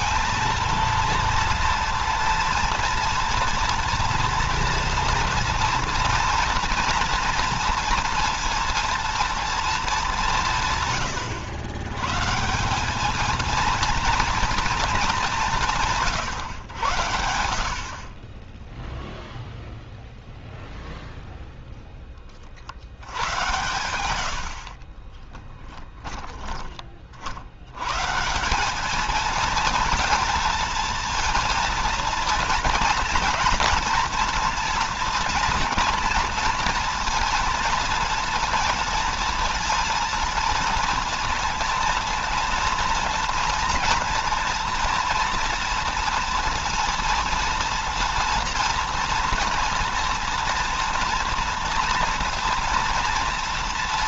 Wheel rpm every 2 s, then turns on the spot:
230, 230, 230, 230, 230, 150, 190, 220, 110, 20, 0, 80, 60, 30, 190, 230, 230, 230, 230, 230, 230, 230, 230, 230, 230, 230, 230.
24-26